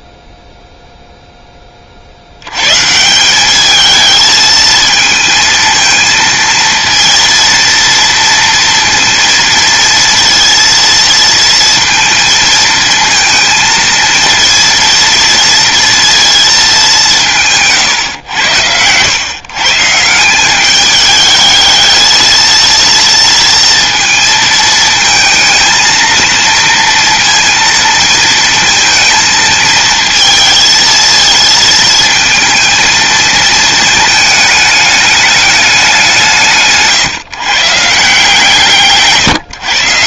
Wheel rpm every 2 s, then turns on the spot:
0, 170, 220, 230, 230, 230, 220, 230, 180, 120, 210, 230, 220, 230, 230, 230, 230, 210, 140, 140.
38-40